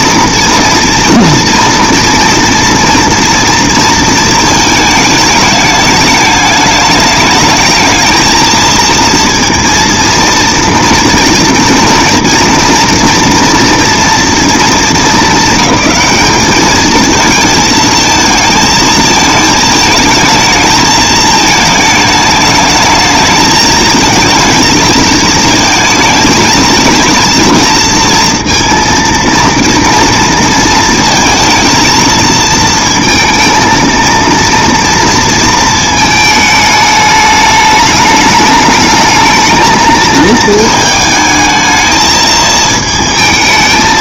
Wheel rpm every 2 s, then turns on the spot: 230, 230, 220, 210, 230, 230, 240, 230, 210, 220, 220, 220, 220, 220, 230, 230, 220, 230, 220, 210, 220, 220.
none